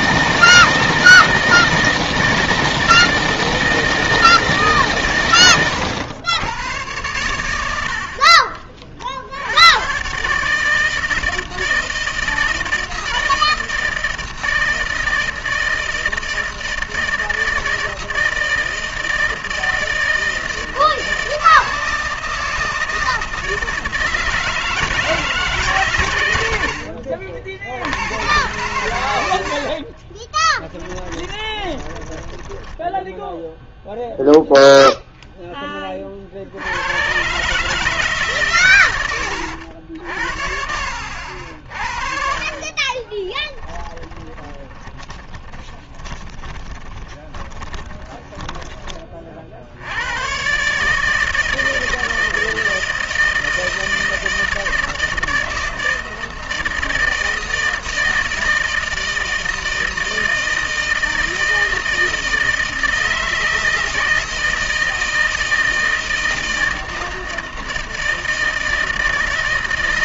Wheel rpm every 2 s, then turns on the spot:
160, 160, 160, 110, 40, 150, 160, 160, 160, 160, 160, 160, 160, 90, 110, 20, 10, 0, 60, 140, 60, 40, 20, 20, 20, 120, 160, 160, 160, 160, 160, 160, 160, 160, 160.
8-10 30-34 42-50